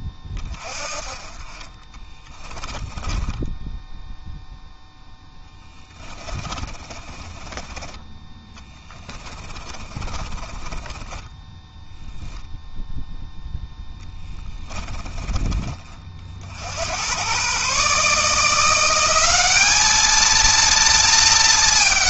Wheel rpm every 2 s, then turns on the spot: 30, 10, 10, 30, 20, 10, 0, 20, 90, 190, 220.
2-4 6-12 14-16